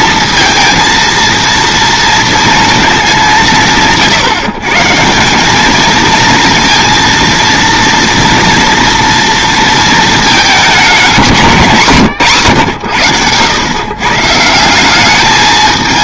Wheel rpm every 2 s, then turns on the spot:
230, 230, 150, 230, 230, 210, 110, 180.
none